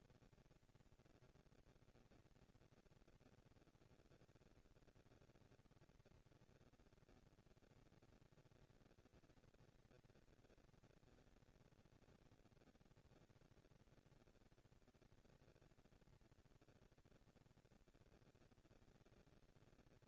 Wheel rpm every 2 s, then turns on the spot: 230, 220, 200, 200, 220, 230, 230, 230, 230, 230.
none